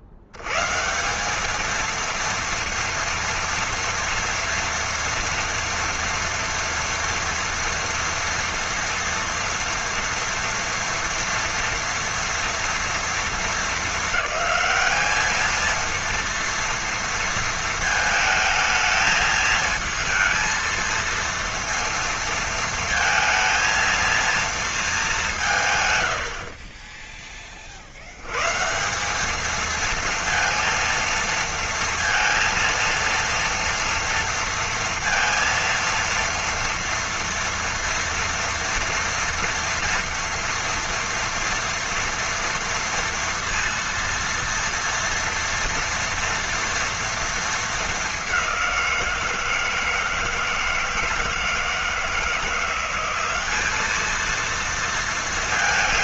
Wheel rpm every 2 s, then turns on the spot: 80, 230, 230, 230, 230, 240, 230, 210, 230, 220, 230, 230, 230, 40, 150, 230, 230, 230, 230, 230, 240, 230, 230, 230, 190, 160, 180, 230.
none